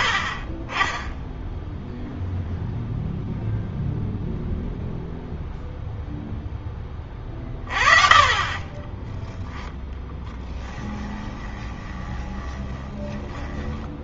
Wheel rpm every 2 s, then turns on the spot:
10, 0, 0, 10, 30, 10, 20.
8-14